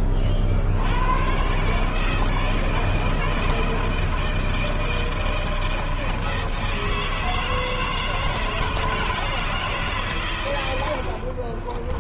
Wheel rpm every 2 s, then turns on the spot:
80, 160, 160, 160, 160, 100.
none